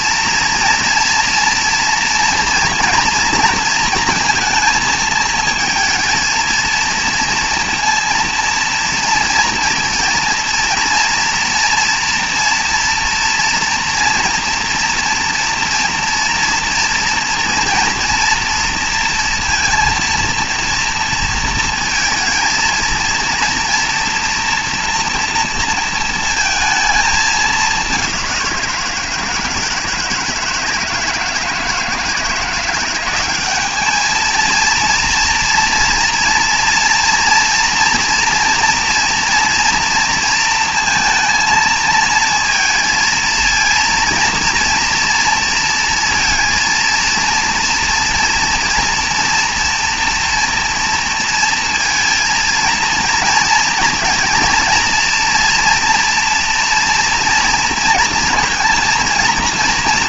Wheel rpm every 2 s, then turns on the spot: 230, 230, 220, 230, 230, 230, 230, 230, 240, 230, 230, 230, 230, 230, 180, 160, 170, 220, 230, 230, 230, 230, 230, 230, 230, 230, 230, 230, 230, 230.
none